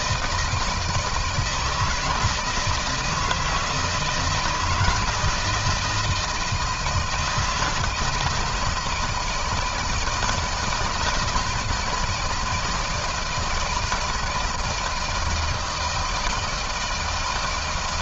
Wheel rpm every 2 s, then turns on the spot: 160, 160, 170, 160, 160, 170, 160, 160, 160.
none